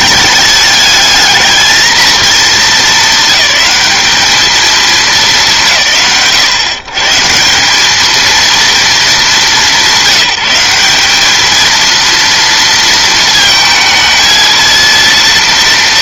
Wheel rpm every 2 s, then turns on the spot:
210, 220, 220, 120, 220, 190, 230, 220.
none